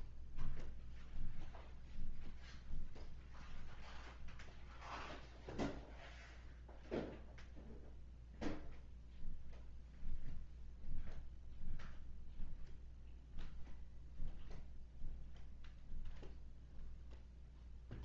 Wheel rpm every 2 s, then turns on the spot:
0, 0, 0, 0, 0, 0, 0, 0, 0.
none